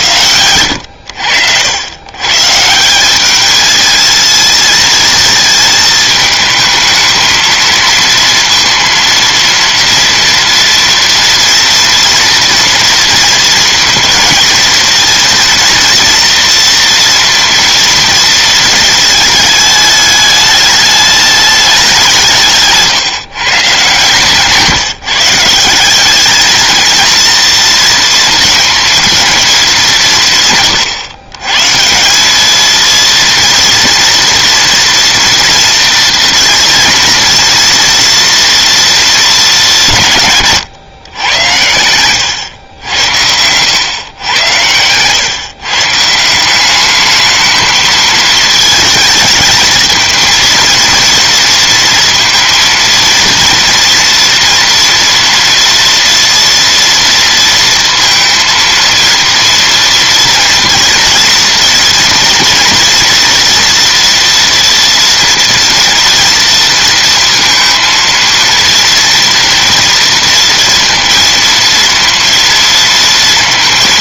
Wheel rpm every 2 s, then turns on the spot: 90, 140, 220, 220, 230, 230, 230, 220, 230, 230, 210, 160, 140, 210, 230, 150, 210, 230, 230, 230, 150, 110, 110, 180, 220, 230, 230, 240, 240, 230, 230, 240, 230, 230, 230, 230, 230.
42-44